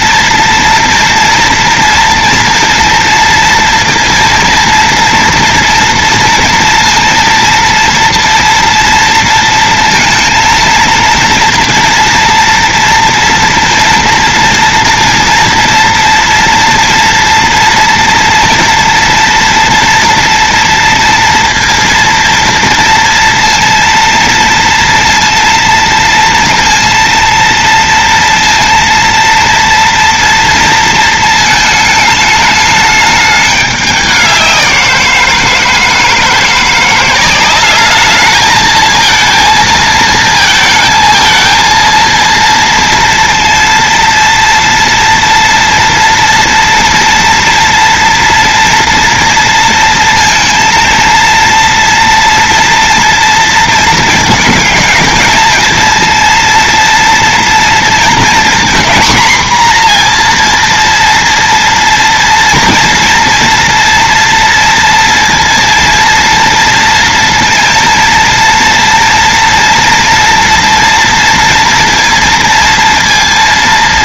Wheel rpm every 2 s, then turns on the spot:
230, 230, 230, 230, 230, 230, 230, 230, 230, 230, 230, 230, 230, 230, 230, 230, 220, 190, 170, 220, 220, 230, 230, 230, 230, 230, 230, 220, 230, 230, 240, 230, 230, 230, 230, 230, 230.
none